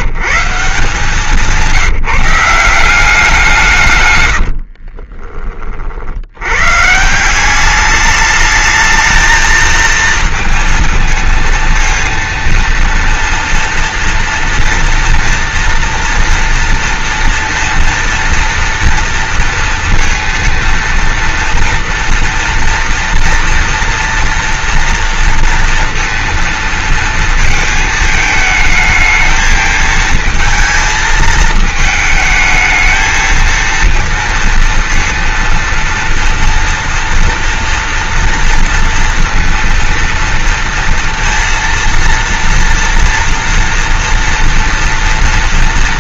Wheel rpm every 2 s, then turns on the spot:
160, 180, 60, 130, 220, 230, 230, 230, 230, 230, 230, 230, 230, 230, 220, 220, 220, 230, 230, 230, 230, 230, 230.
4-6